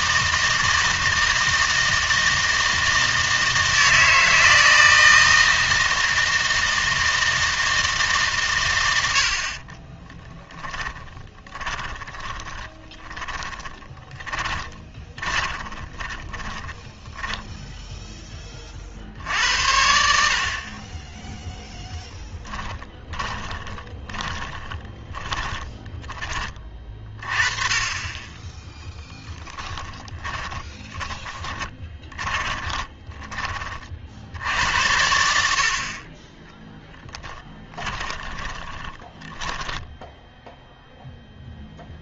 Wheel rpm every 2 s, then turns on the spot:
160, 160, 160, 160, 110, 20, 20, 20, 10, 30, 50, 20, 30, 30, 10, 20, 20, 70, 10, 20, 0.
10-18 22-26 30-34 36-40